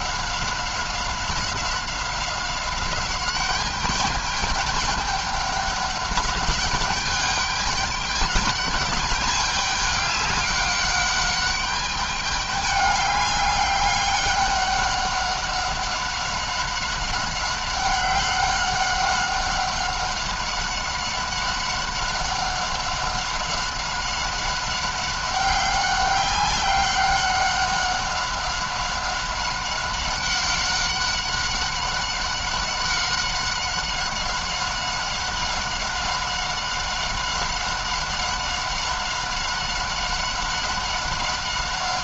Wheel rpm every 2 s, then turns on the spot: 190, 190, 210, 210, 210, 200, 200, 200, 200, 190, 190, 190, 190, 200, 190, 190, 190, 190, 190, 190, 190.
none